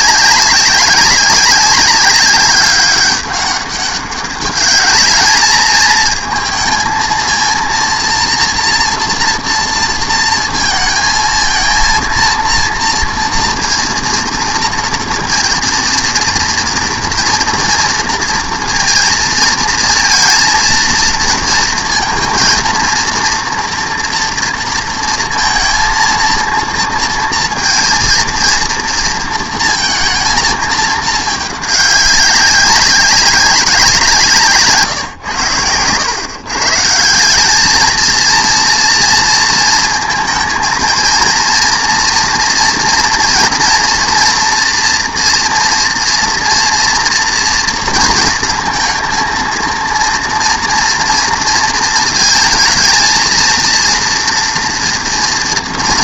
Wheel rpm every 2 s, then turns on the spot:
200, 200, 210, 220, 230, 230, 230, 230, 230, 230, 230, 230, 230, 230, 230, 220, 190, 140, 140, 230, 220, 240, 230, 240, 230, 230, 220, 230.
none